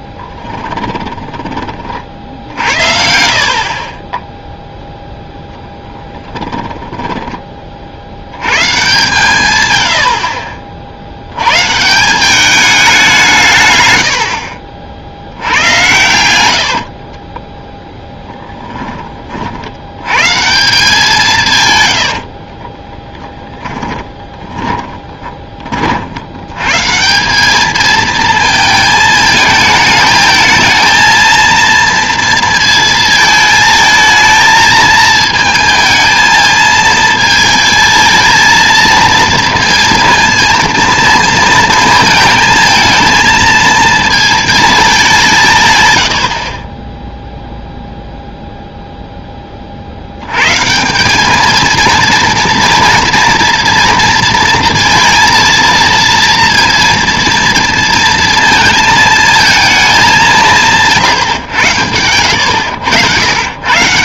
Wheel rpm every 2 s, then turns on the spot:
10, 60, 0, 20, 120, 50, 200, 60, 60, 20, 160, 40, 10, 120, 220, 220, 230, 220, 220, 220, 230, 220, 220, 30, 0, 150, 230, 230, 230, 230, 160, 90.
0-4 6-8 16-18 22-26 62-64